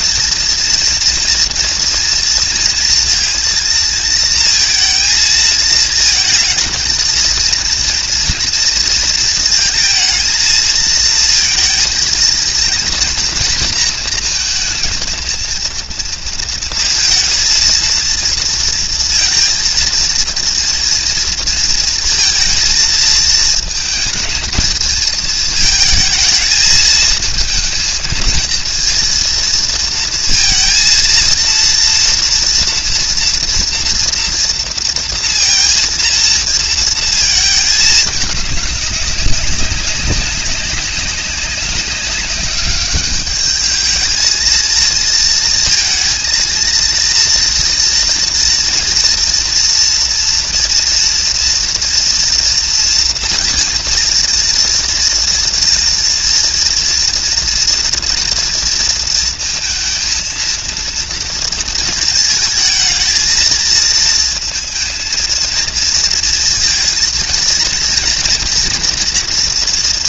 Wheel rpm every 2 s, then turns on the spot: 230, 230, 230, 220, 240, 230, 230, 230, 220, 230, 230, 230, 220, 220, 230, 230, 230, 240, 230, 200, 200, 200, 220, 230, 230, 230, 230, 230, 240, 230, 230, 220, 220, 230, 230.
none